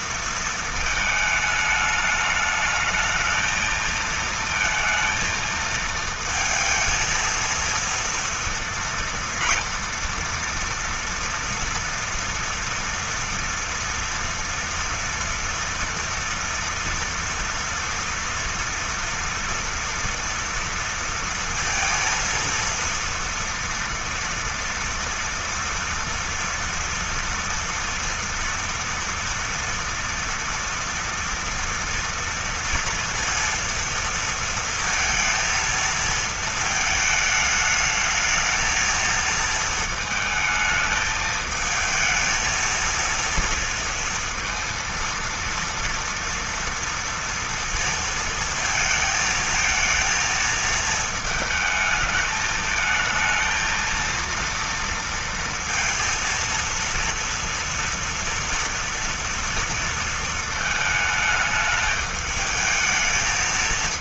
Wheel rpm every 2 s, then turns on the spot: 230, 210, 230, 230, 230, 230, 240, 230, 230, 230, 230, 230, 230, 240, 230, 230, 230, 230, 220, 220, 220, 230, 230, 230, 230, 220, 220, 230, 230, 230, 230, 220.
none